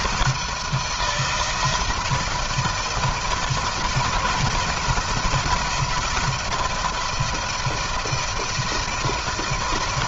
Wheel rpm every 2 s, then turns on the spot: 160, 160, 170, 170, 160.
none